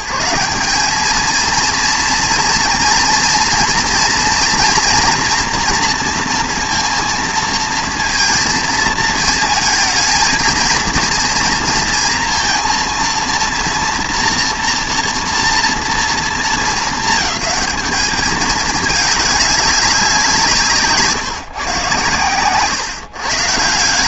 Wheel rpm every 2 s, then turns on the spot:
180, 230, 240, 230, 220, 230, 230, 230, 220, 210, 160, 140.
none